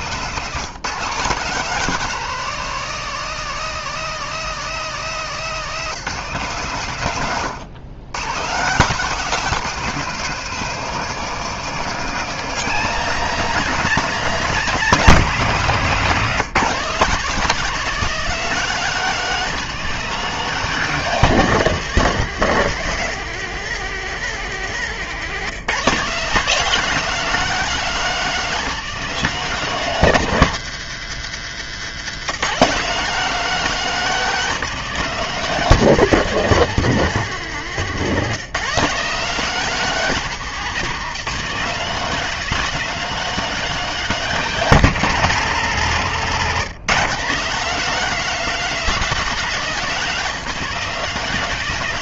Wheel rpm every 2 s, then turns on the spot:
170, 200, 200, 150, 160, 210, 220, 210, 180, 200, 200, 180, 170, 200, 210, 150, 180, 180, 180, 170, 170, 210, 200, 170, 210, 180.
none